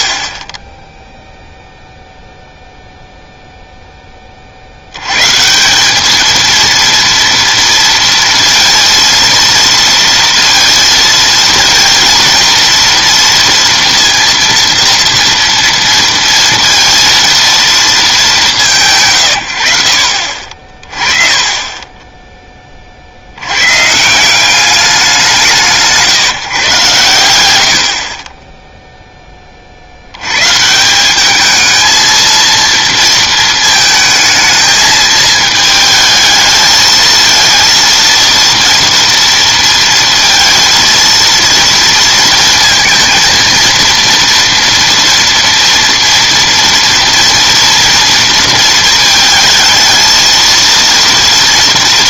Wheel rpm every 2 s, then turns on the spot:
10, 0, 50, 230, 230, 230, 230, 230, 230, 170, 40, 20, 170, 140, 20, 130, 230, 220, 220, 230, 230, 230, 230, 230, 230, 230.
none